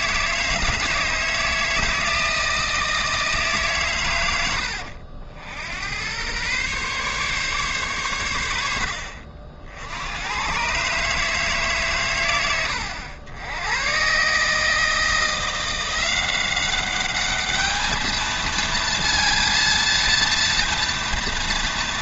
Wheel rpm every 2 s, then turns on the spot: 160, 160, 80, 130, 80, 130, 100, 150, 190, 220, 230.
none